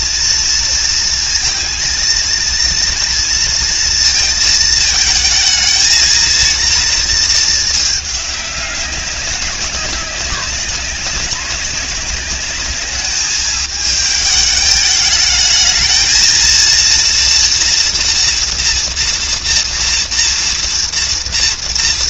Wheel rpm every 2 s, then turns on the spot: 230, 230, 220, 230, 190, 200, 210, 210, 230, 240, 230.
none